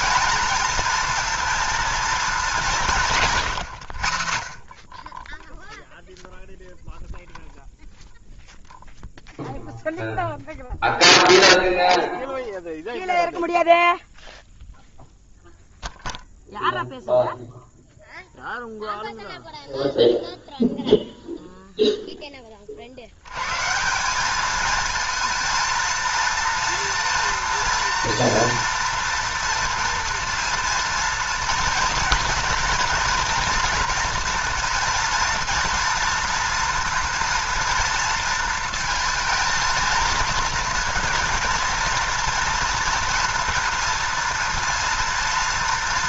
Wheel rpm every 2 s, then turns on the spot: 230, 170, 30, 0, 0, 0, 0, 0, 0, 0, 0, 50, 220, 230, 230, 230, 230, 240, 230, 230, 240, 230, 230.
none